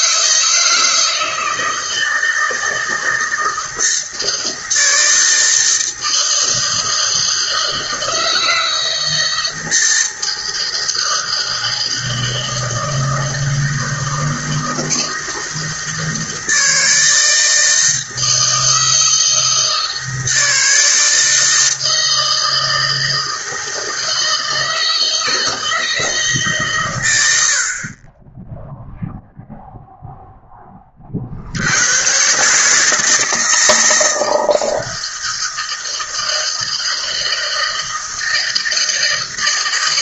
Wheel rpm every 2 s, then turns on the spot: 160, 160, 160, 160, 160, 160, 160, 160, 160, 160, 160, 160, 160, 110, 0, 30, 160, 160, 160, 160.
none